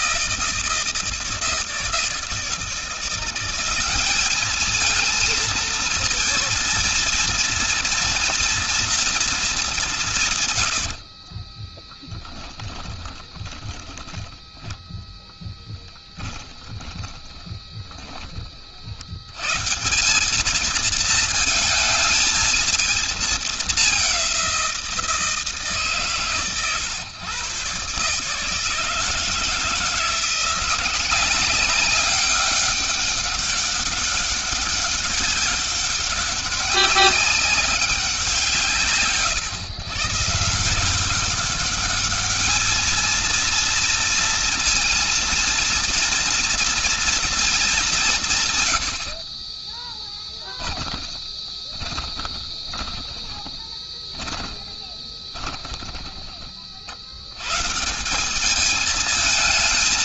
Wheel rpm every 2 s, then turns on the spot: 160, 160, 220, 230, 230, 110, 10, 10, 10, 40, 210, 220, 180, 130, 150, 170, 200, 200, 200, 170, 160, 220, 230, 230, 150, 20, 20, 20, 40, 210.
12-14 16-18 50-56